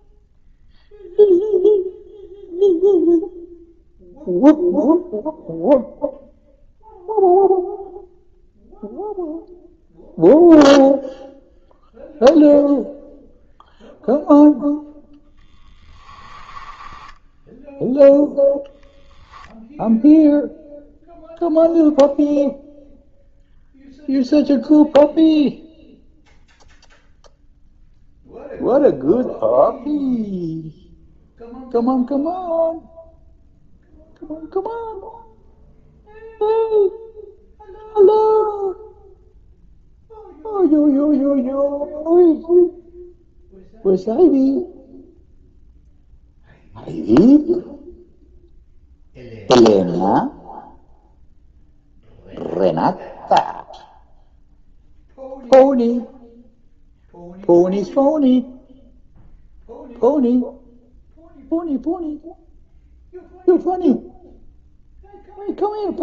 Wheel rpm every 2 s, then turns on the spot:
0, 0, 0, 0, 0, 0, 0, 0, 10, 0, 0, 0, 0, 0, 0, 0, 0, 0, 0, 0, 0, 0, 0, 0, 0, 0, 0, 0, 0, 0, 0, 0, 0.
16-18